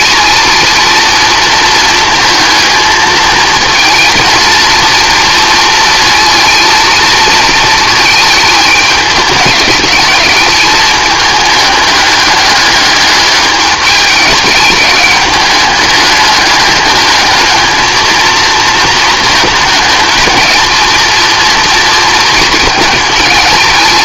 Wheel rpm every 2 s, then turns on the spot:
230, 220, 230, 230, 210, 210, 210, 210, 210, 220, 230, 220.
none